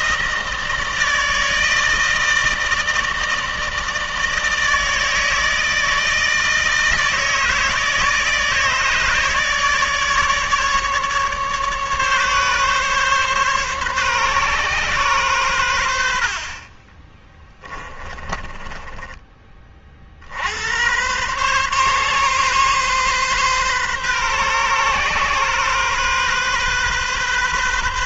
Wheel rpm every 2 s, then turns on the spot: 160, 160, 160, 160, 150, 150, 140, 130, 40, 20, 70, 130, 130, 130.
16-20